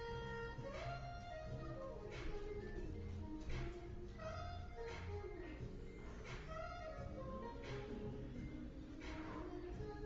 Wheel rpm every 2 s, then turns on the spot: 0, 0, 0, 0, 0.
none